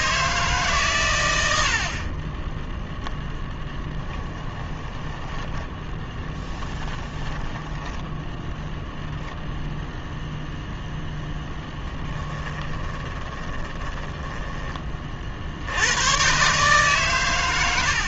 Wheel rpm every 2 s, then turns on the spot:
140, 0, 10, 20, 0, 0, 20, 30, 140.
4-8 12-14